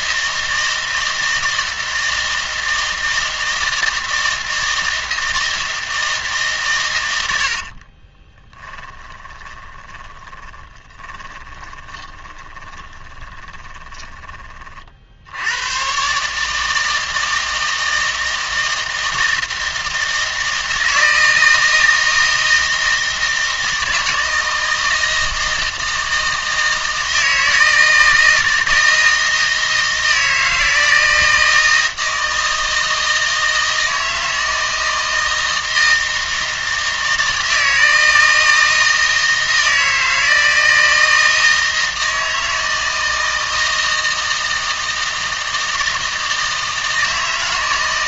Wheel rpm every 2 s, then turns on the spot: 160, 160, 160, 130, 10, 20, 20, 40, 160, 160, 160, 160, 160, 160, 160, 160, 160, 160, 160, 160, 160, 160, 160, 160.
8-14